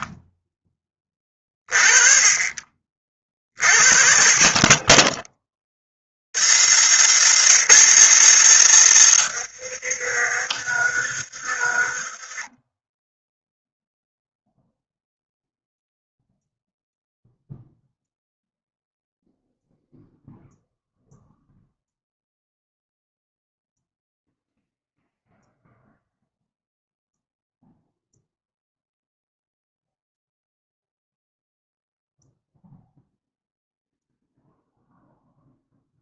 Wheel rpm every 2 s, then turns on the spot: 10, 30, 20, 160, 160, 60, 10, 0, 0, 0, 0, 0, 0, 0, 0, 0, 0, 0.
8-14